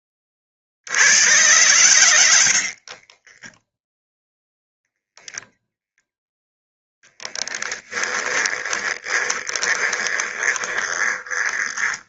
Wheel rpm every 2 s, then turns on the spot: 60, 70, 0, 0, 30, 20.
2-4 8-12